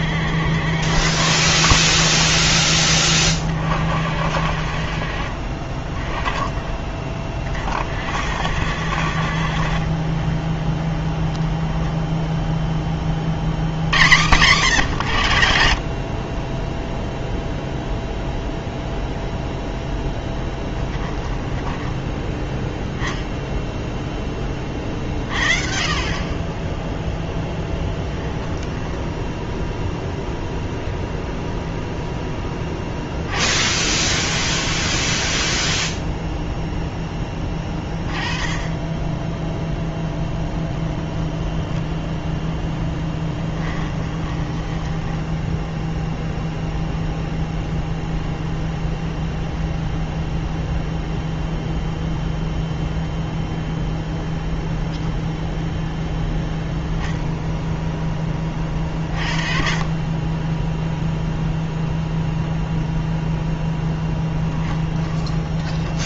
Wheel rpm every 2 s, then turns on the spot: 70, 30, 50, 20, 70, 10, 10, 140, 20, 0, 10, 10, 30, 20, 10, 0, 10, 0, 0, 20, 0, 0, 10, 0, 0, 0, 0, 0, 10, 30, 10, 0, 10.
20-22 28-30 44-46 64-66